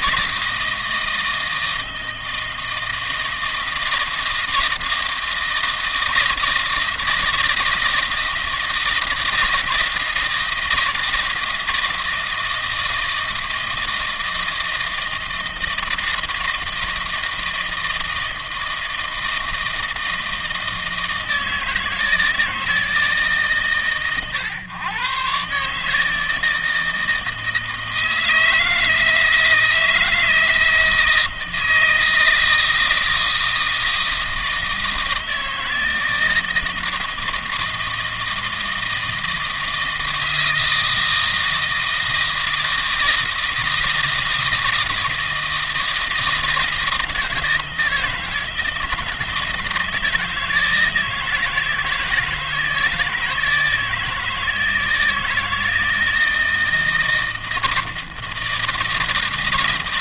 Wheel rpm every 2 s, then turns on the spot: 160, 160, 160, 160, 160, 160, 160, 160, 160, 160, 160, 150, 120, 160, 160, 160, 160, 160, 160, 160, 160, 160, 160, 160, 160, 160, 160, 160, 160, 160.
none